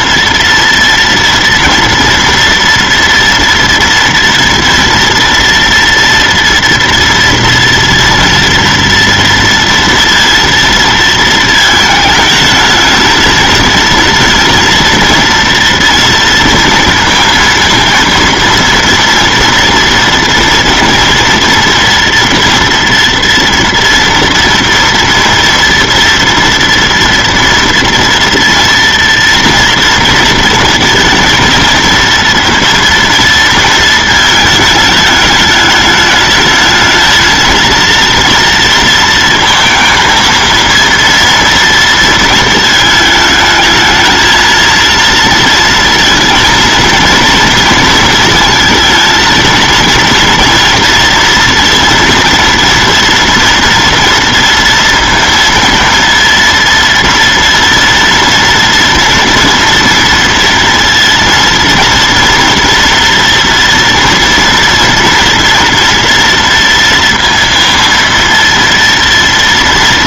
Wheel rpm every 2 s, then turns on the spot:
230, 230, 230, 230, 230, 230, 220, 230, 230, 230, 230, 230, 230, 230, 240, 220, 230, 220, 220, 230, 230, 220, 230, 230, 220, 230, 230, 230, 230, 230, 230, 230, 230, 230, 230.
none